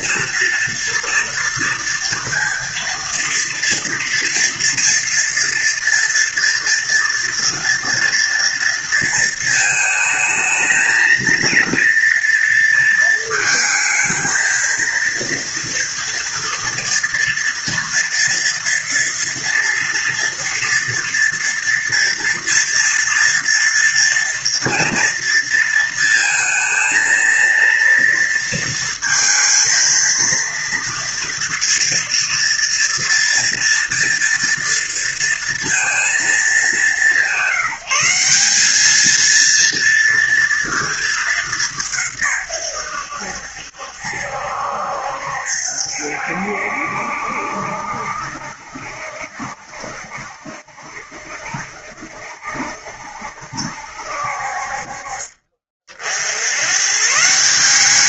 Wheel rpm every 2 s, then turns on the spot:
230, 230, 240, 230, 230, 220, 230, 220, 230, 230, 230, 230, 240, 220, 230, 230, 230, 230, 200, 190, 230, 130, 70, 70, 70, 70, 70, 50, 100.
none